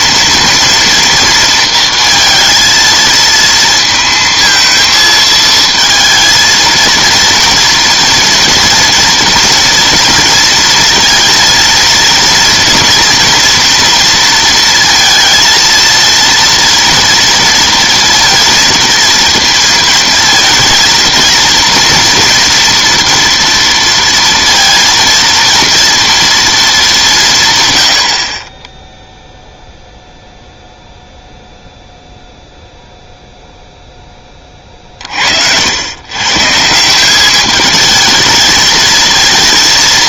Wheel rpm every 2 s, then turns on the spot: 230, 230, 220, 230, 230, 230, 230, 230, 240, 230, 230, 230, 230, 220, 20, 0, 0, 30, 170, 220.
none